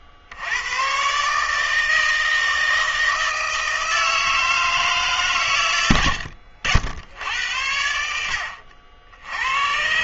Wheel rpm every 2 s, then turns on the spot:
90, 160, 160, 80, 60.
none